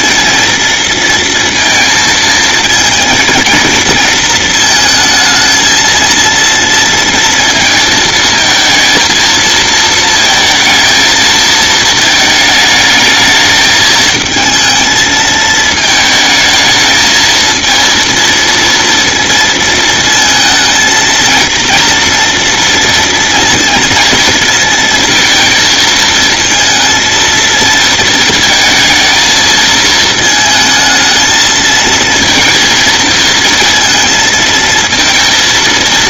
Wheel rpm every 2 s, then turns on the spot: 230, 230, 220, 230, 230, 220, 220, 220, 220, 230, 220, 230, 230, 230, 230, 220, 230, 230.
none